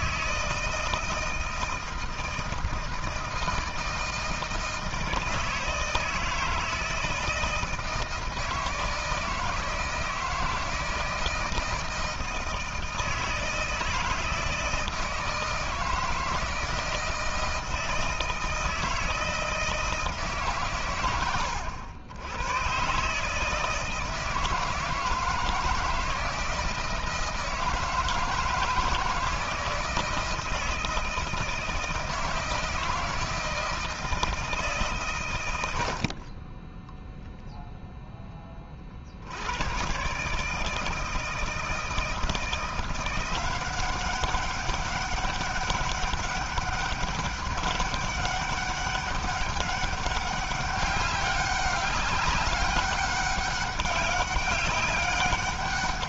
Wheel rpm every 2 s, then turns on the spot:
160, 160, 160, 160, 160, 160, 160, 160, 160, 160, 120, 130, 160, 160, 160, 160, 160, 140, 10, 50, 160, 170, 200, 200, 200, 200, 200, 200.
none